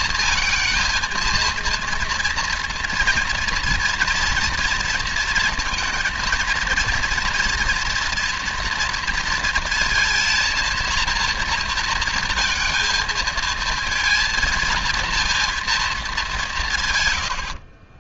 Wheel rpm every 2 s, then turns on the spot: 230, 230, 230, 230, 230, 230, 230, 230, 140.
none